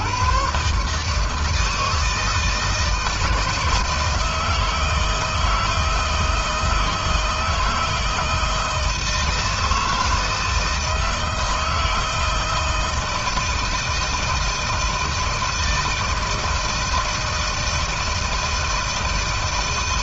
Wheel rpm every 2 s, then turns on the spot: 140, 160, 160, 160, 160, 160, 160, 160, 160, 160.
none